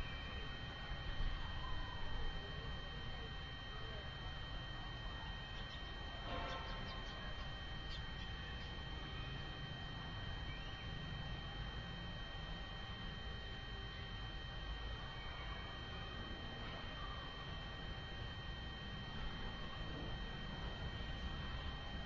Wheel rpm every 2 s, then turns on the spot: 0, 0, 0, 0, 0, 0, 0, 0, 0, 0, 0.
none